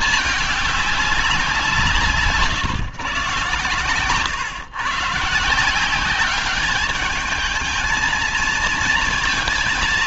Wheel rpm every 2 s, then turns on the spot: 210, 150, 130, 200, 230.
none